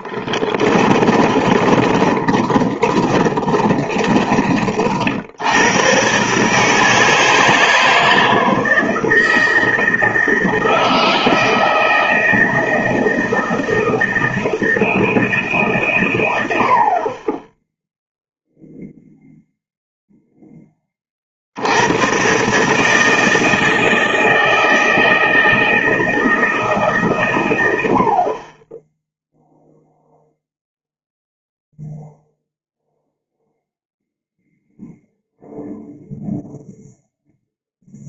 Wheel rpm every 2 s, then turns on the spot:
20, 30, 50, 150, 160, 160, 160, 160, 60, 0, 20, 150, 160, 150, 20, 0, 0, 0, 0.
0-4